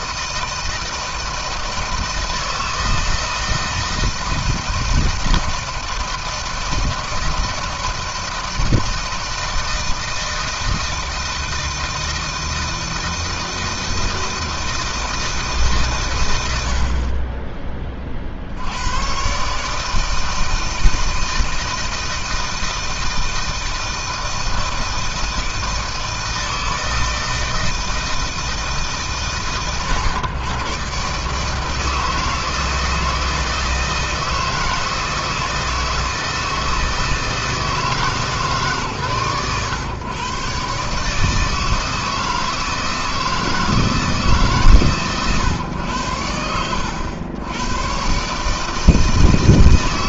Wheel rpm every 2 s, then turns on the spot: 160, 160, 160, 160, 160, 160, 160, 160, 90, 80, 160, 160, 160, 160, 160, 130, 160, 160, 160, 150, 130, 160, 160, 100, 150.
none